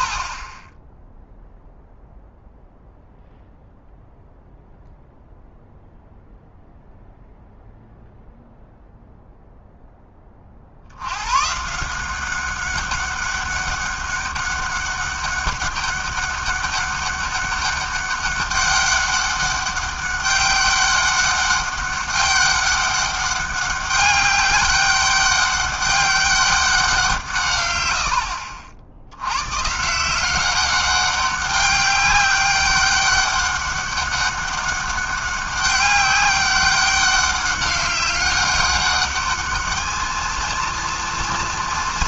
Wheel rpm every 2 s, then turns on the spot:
10, 0, 0, 0, 0, 70, 200, 200, 200, 200, 200, 200, 200, 190, 60, 190, 200, 200, 190, 200, 230.
none